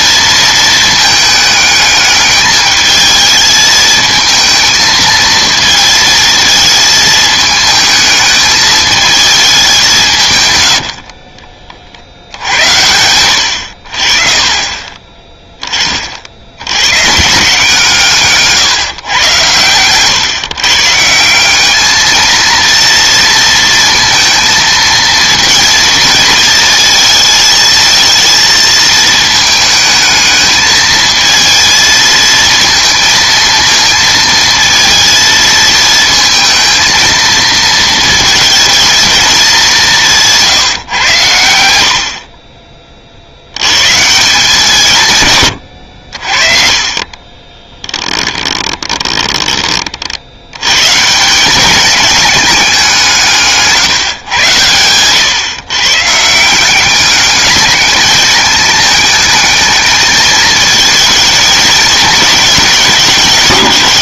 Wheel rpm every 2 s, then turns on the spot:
220, 210, 220, 220, 220, 100, 90, 30, 90, 140, 150, 230, 230, 220, 230, 220, 230, 230, 220, 220, 150, 40, 170, 40, 20, 120, 200, 130, 180, 210, 220, 220.
10-12 46-50